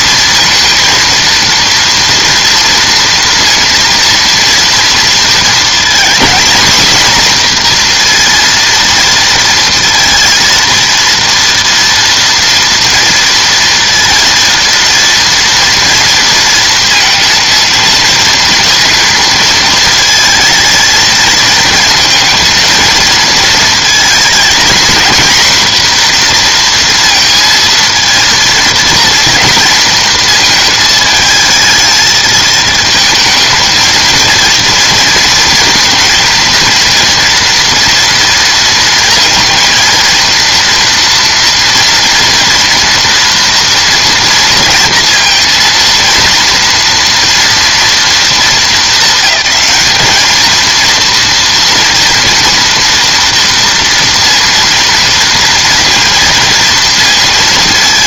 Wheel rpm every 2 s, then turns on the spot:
230, 230, 230, 240, 230, 230, 230, 230, 230, 230, 220, 220, 230, 240, 230, 220, 220, 230, 230, 230, 230, 230, 230, 230, 220, 220, 230, 230, 230.
none